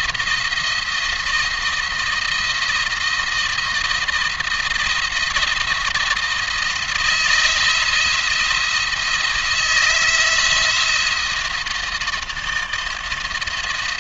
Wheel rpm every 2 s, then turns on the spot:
170, 170, 170, 170, 170, 170, 160.
none